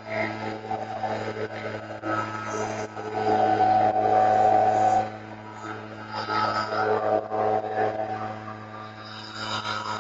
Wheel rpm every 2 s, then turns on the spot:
0, 0, 0, 0, 0.
none